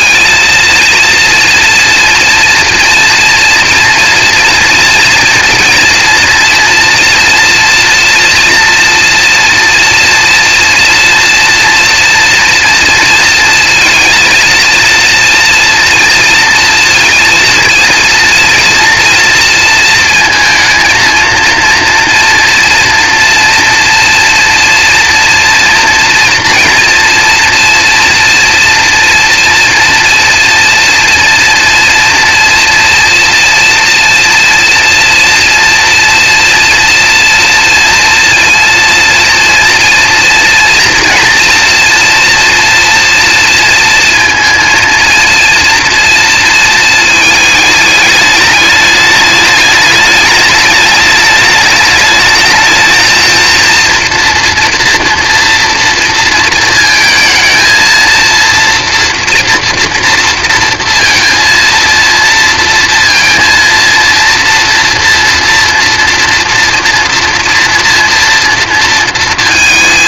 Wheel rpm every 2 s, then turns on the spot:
230, 230, 230, 240, 230, 230, 230, 240, 230, 230, 230, 230, 230, 230, 240, 230, 230, 230, 230, 240, 240, 230, 230, 220, 210, 210, 230, 240, 230, 240, 230, 230, 230, 240, 230.
none